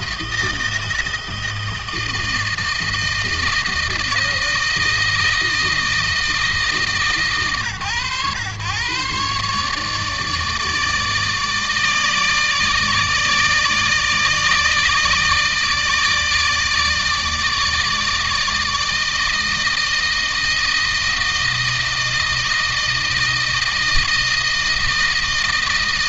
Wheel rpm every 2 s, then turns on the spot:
160, 160, 160, 150, 130, 150, 150, 160, 150, 160, 160, 160, 160.
none